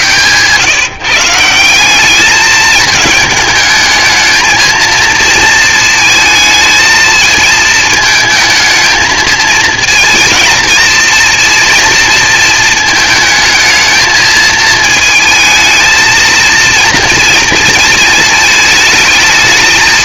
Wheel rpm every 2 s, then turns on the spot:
150, 210, 220, 220, 220, 230, 220, 220, 230, 220.
none